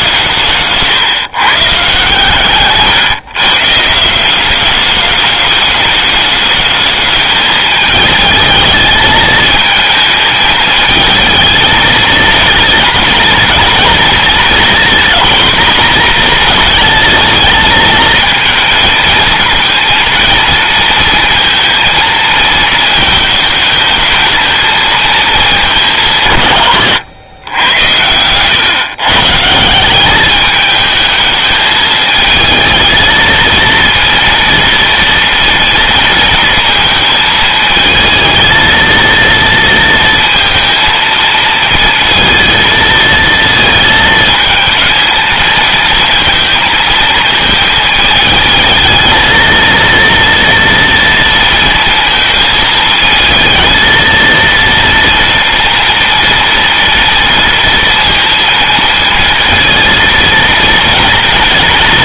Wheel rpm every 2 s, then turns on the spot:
140, 140, 200, 210, 220, 220, 230, 230, 230, 220, 230, 230, 230, 110, 140, 220, 220, 230, 230, 230, 230, 230, 220, 220, 220, 230, 220, 230, 230, 230, 230.
none